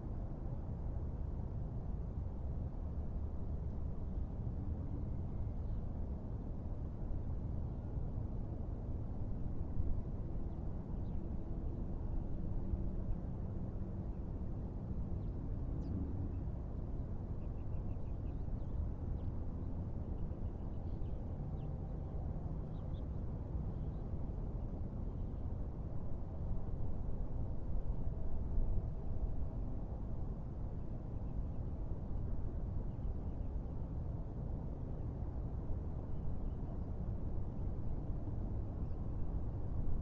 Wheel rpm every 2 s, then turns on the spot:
0, 0, 0, 0, 0, 0, 0, 0, 0, 0, 0, 0, 0, 0, 0, 0, 0, 0, 0, 0.
none